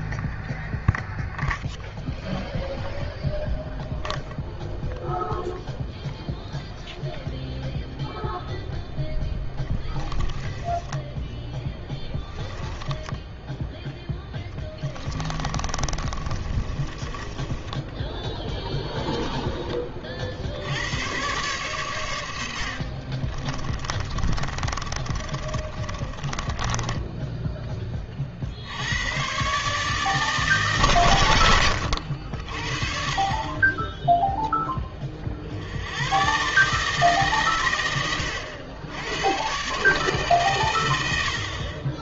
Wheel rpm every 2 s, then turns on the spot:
0, 0, 0, 0, 10, 20, 10, 10, 30, 10, 90, 60, 30, 20, 60, 150, 60, 0, 130, 100, 130.
10-20 24-28